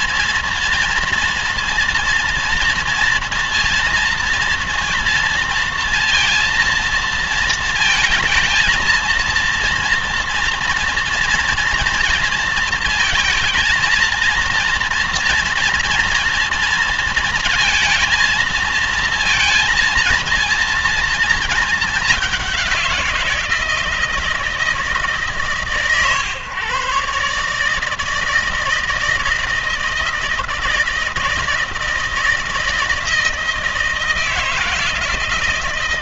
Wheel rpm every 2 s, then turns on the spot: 230, 230, 230, 230, 220, 230, 220, 230, 230, 230, 230, 180, 150, 140, 160, 160, 160, 160.
none